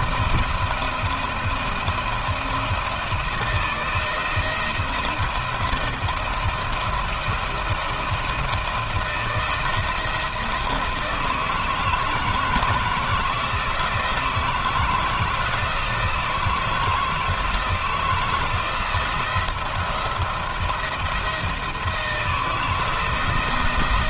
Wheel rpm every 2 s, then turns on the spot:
170, 170, 170, 170, 170, 160, 160, 160, 160, 170, 170, 170.
none